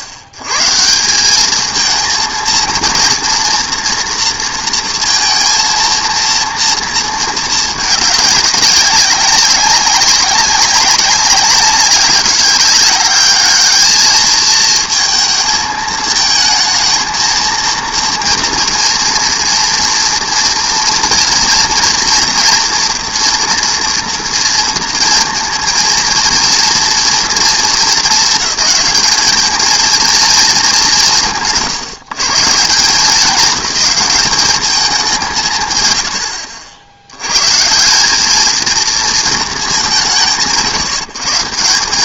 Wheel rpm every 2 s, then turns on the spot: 100, 230, 230, 230, 200, 190, 200, 220, 220, 230, 230, 230, 230, 230, 210, 210, 160, 200, 80, 220, 120.
none